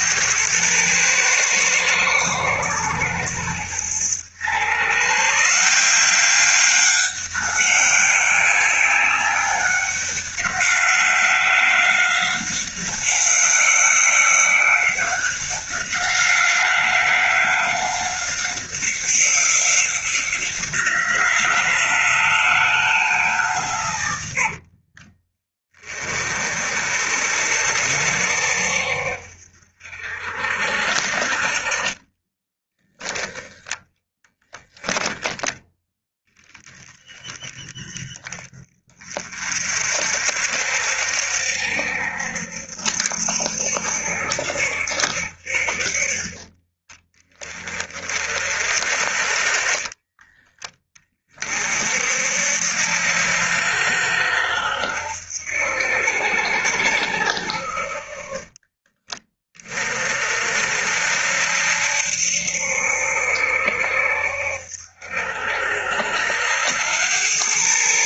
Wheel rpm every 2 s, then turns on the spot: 110, 110, 140, 200, 200, 190, 190, 190, 190, 190, 180, 170, 40, 50, 60, 50, 10, 0, 20, 30, 60, 60, 70, 20, 40, 20, 70, 80, 80, 30, 60, 70, 70, 90.
24-26